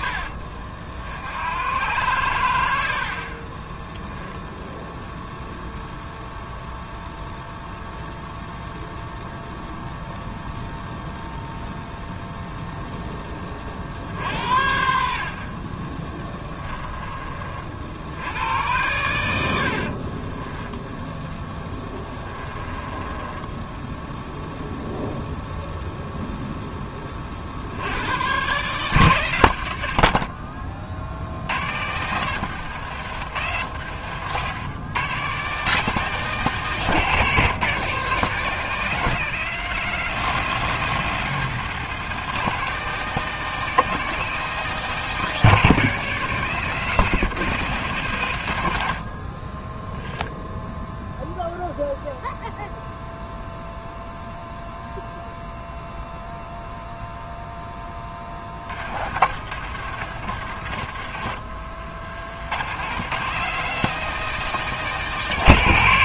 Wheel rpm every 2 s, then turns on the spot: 70, 60, 0, 0, 0, 0, 10, 70, 20, 100, 0, 20, 0, 20, 120, 60, 100, 120, 160, 170, 170, 170, 180, 160, 60, 0, 0, 0, 0, 50, 60, 140, 180.
22-24 32-34 58-60